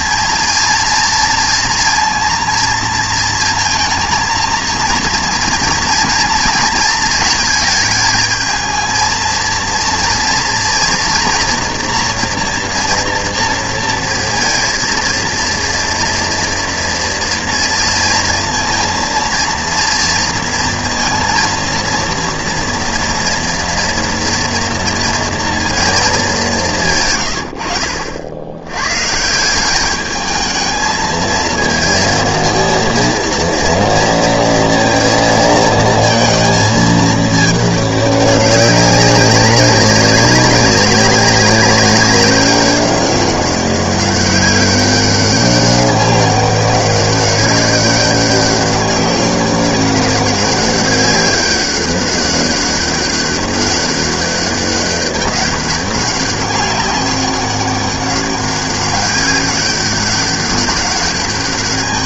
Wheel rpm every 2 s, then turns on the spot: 230, 230, 230, 230, 220, 230, 240, 230, 230, 230, 230, 230, 230, 170, 100, 220, 230, 230, 220, 200, 200, 190, 190, 190, 200, 200, 200, 200, 200, 200, 200.
none